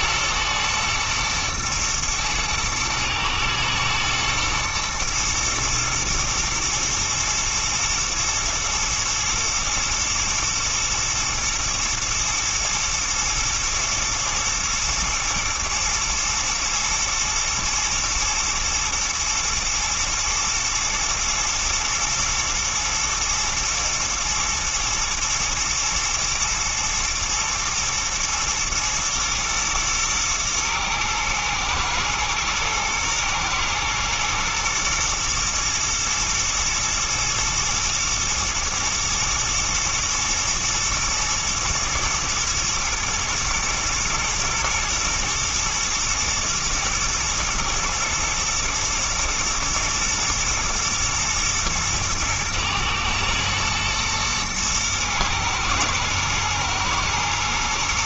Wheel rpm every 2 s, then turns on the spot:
120, 110, 120, 110, 120, 120, 120, 110, 120, 110, 110, 110, 110, 110, 120, 110, 110, 120, 110, 110, 110, 110, 120, 120, 110, 110, 110, 110, 110.
none